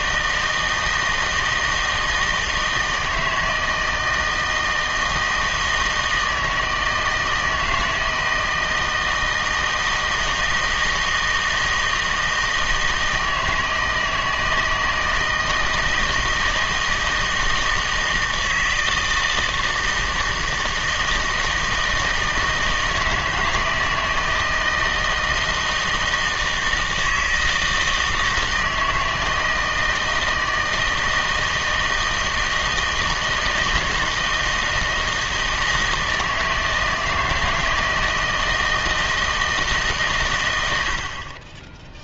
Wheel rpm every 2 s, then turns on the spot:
160, 160, 160, 160, 160, 160, 160, 160, 160, 160, 160, 160, 160, 160, 160, 160, 160, 160, 160, 160, 90.
none